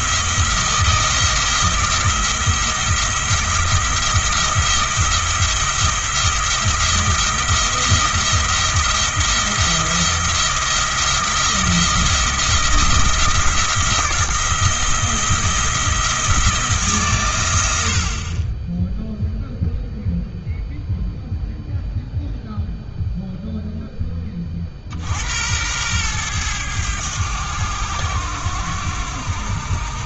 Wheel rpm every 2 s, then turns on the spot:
170, 170, 170, 170, 170, 170, 170, 170, 160, 10, 0, 0, 50, 100, 90.
none